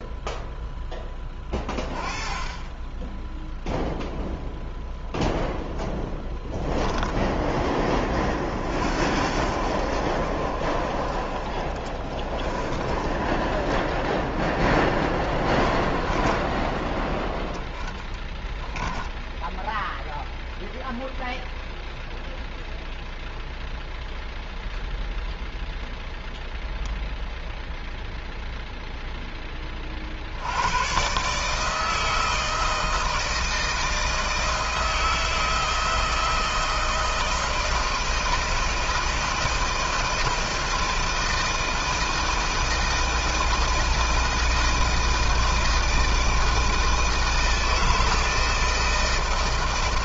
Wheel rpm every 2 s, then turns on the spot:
0, 20, 0, 10, 50, 50, 40, 10, 10, 10, 0, 0, 0, 0, 0, 90, 160, 160, 160, 160, 160, 160, 160, 160, 160.
18-20